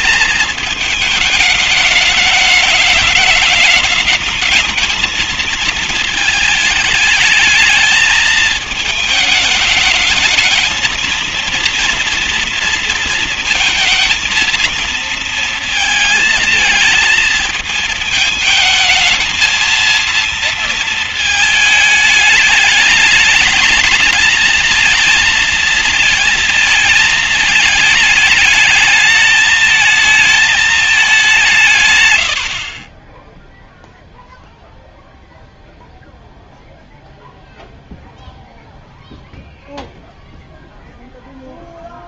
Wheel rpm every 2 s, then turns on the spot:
220, 210, 210, 220, 220, 220, 230, 230, 220, 220, 230, 210, 230, 220, 210, 210, 80, 0, 0, 0, 0.
32-34